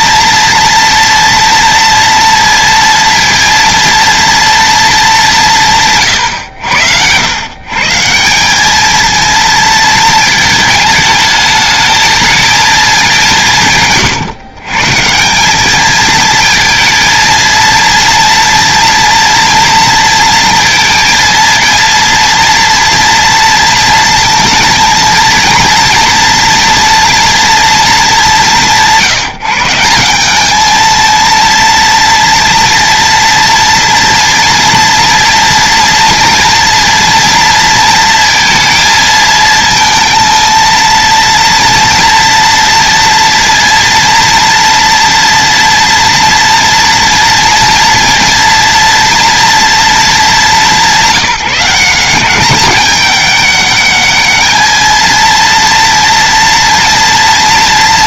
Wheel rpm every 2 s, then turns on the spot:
230, 230, 210, 90, 220, 220, 210, 150, 230, 230, 230, 240, 230, 230, 160, 220, 230, 230, 230, 230, 230, 240, 230, 230, 230, 190, 200, 230, 240.
none